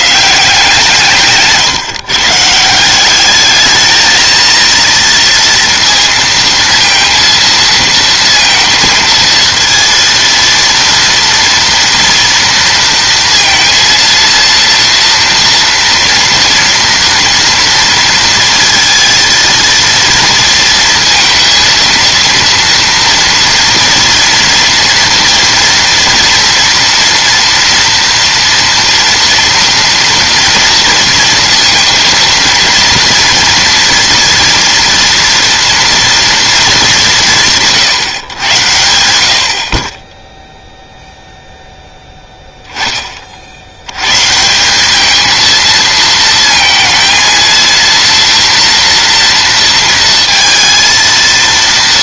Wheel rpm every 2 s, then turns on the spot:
170, 160, 230, 230, 230, 230, 230, 230, 230, 230, 230, 230, 230, 230, 230, 230, 230, 230, 220, 90, 0, 10, 170, 220, 230, 230.
none